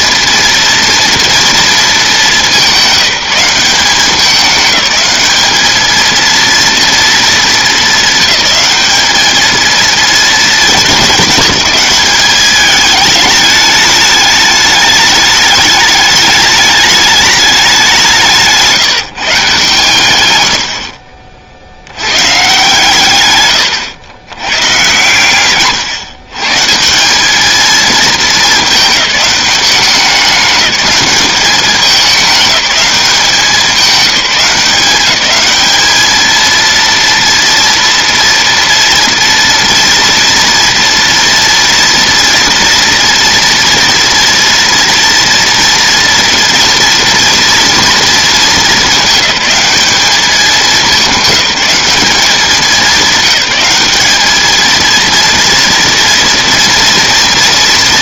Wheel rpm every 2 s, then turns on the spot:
230, 200, 200, 230, 210, 220, 200, 210, 210, 180, 120, 150, 130, 150, 220, 200, 210, 180, 230, 240, 230, 230, 230, 230, 220, 210, 210, 220, 240.
none